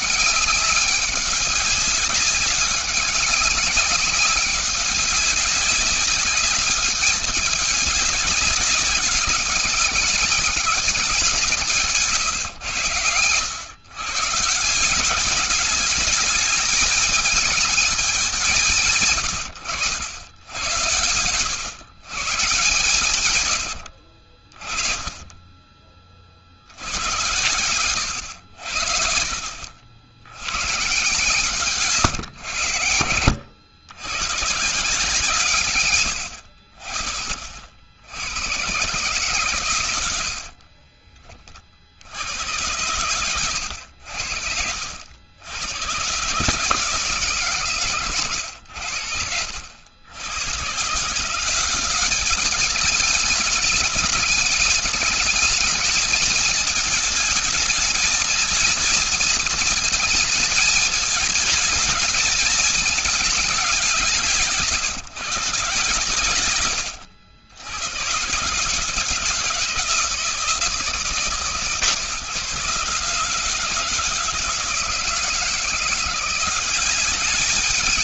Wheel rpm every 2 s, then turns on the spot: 200, 190, 190, 200, 190, 200, 110, 160, 220, 180, 100, 130, 40, 60, 80, 110, 110, 130, 60, 120, 50, 90, 70, 150, 100, 100, 210, 210, 220, 230, 220, 220, 150, 110, 130, 160, 150, 160, 180.
40-42